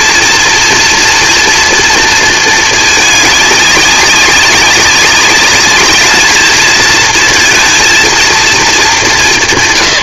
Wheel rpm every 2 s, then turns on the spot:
230, 220, 200, 220, 230.
none